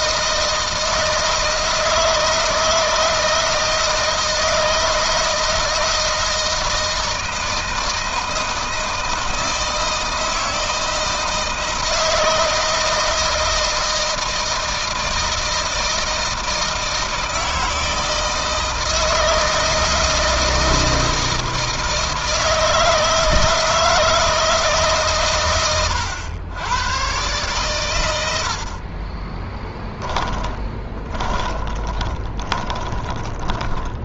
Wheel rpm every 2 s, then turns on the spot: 160, 160, 160, 160, 160, 160, 160, 160, 160, 160, 160, 160, 150, 110, 40, 10, 20.
28-34